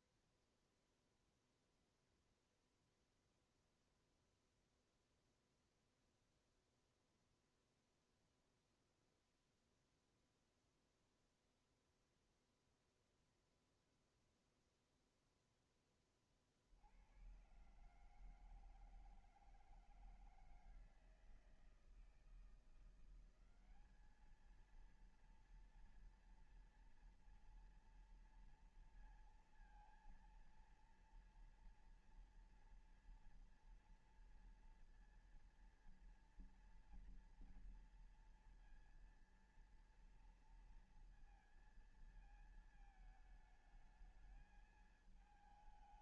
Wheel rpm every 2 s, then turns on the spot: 0, 0, 0, 0, 0, 0, 0, 0, 40, 150, 160, 170, 210, 230, 230, 230, 240, 230, 230, 230, 230, 220, 220.
none